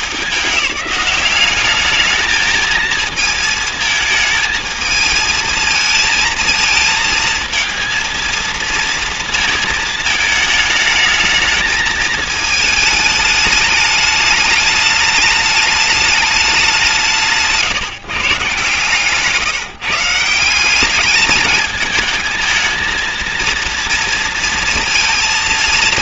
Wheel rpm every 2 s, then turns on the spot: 200, 220, 220, 230, 230, 210, 220, 210, 190, 150, 180, 220, 230.
none